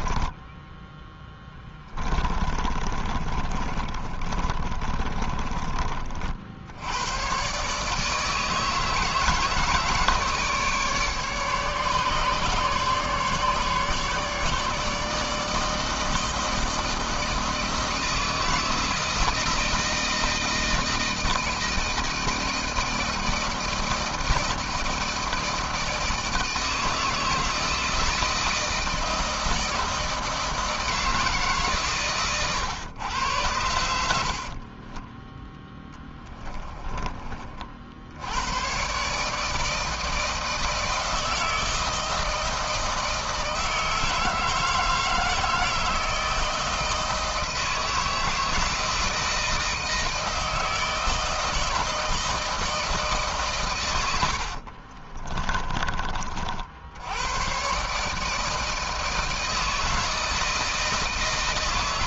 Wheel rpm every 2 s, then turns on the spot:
10, 30, 30, 110, 160, 150, 150, 150, 160, 160, 160, 160, 160, 160, 160, 160, 110, 30, 30, 130, 160, 160, 160, 160, 160, 160, 160, 40, 70, 160, 160.
0-6 34-36 54-56